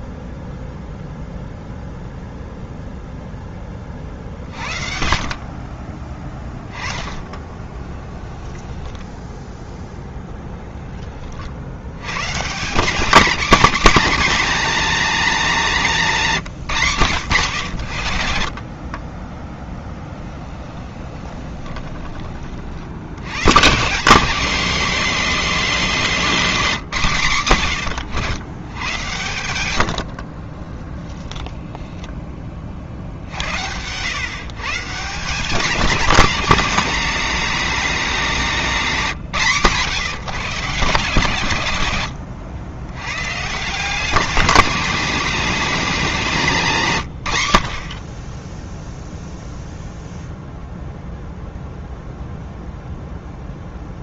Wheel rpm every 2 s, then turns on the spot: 0, 0, 50, 20, 10, 10, 170, 240, 160, 40, 20, 60, 220, 200, 110, 20, 40, 150, 210, 190, 160, 100, 190, 170, 10, 0, 0.
6-10 20-22 30-32